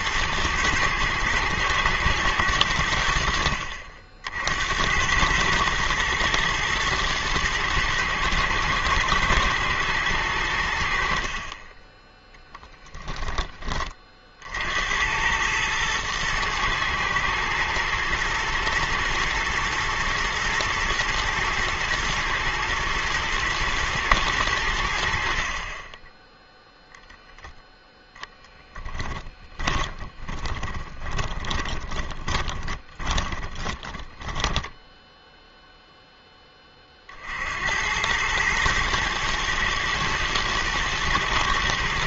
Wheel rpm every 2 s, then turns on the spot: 110, 80, 90, 110, 120, 60, 10, 80, 110, 120, 110, 120, 80, 0, 10, 20, 20, 10, 40, 110, 110.
12-14 28-36